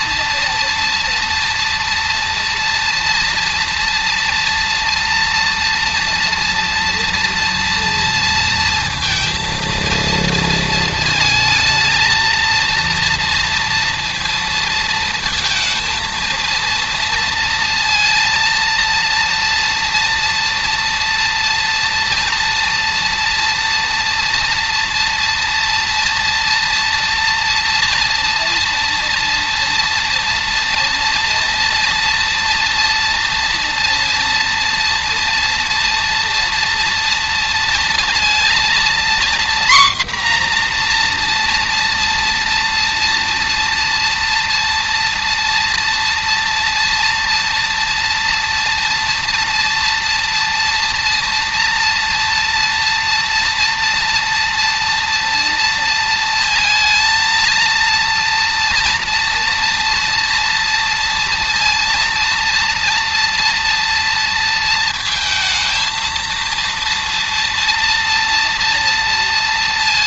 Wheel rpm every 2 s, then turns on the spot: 230, 230, 230, 240, 230, 220, 230, 230, 230, 230, 230, 230, 230, 230, 230, 230, 230, 230, 230, 240, 240, 230, 230, 230, 230, 230, 240, 230, 230, 230, 230, 230, 230, 230, 230.
none